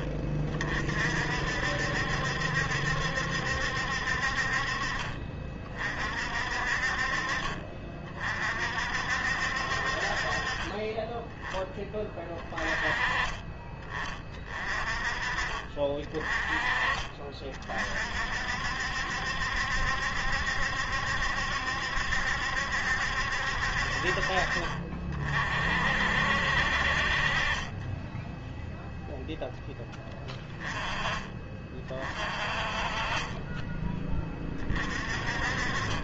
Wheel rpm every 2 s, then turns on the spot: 60, 70, 40, 50, 50, 20, 20, 30, 30, 60, 70, 70, 40, 50, 0, 20, 30, 40.
none